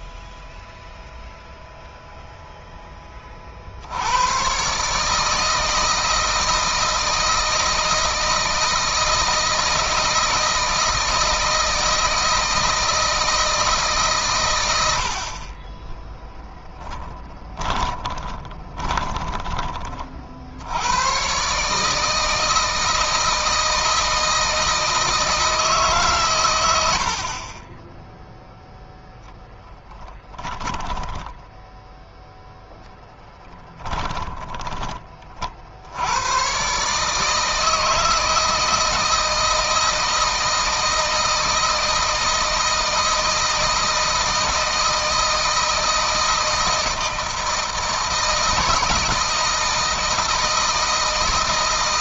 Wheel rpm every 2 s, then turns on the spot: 0, 0, 120, 160, 160, 160, 160, 100, 20, 20, 70, 160, 160, 90, 0, 10, 0, 30, 130, 160, 160, 160, 160, 160, 160, 160.
16-20 30-32